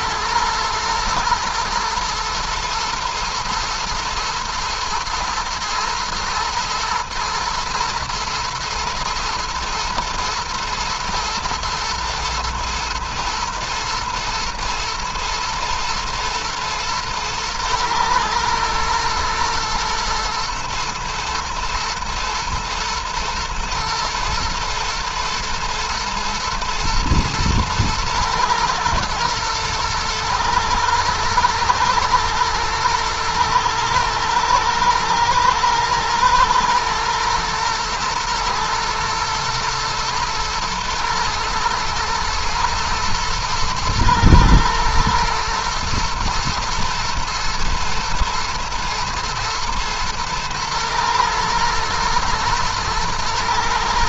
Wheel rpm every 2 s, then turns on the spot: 110, 120, 110, 110, 110, 110, 110, 110, 110, 110, 110, 110, 110, 110, 110, 110, 110, 110, 110, 110, 110, 110, 120, 110, 110, 120, 110.
none